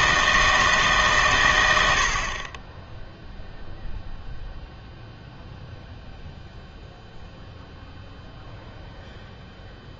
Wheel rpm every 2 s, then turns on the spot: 150, 10, 0, 0, 0.
none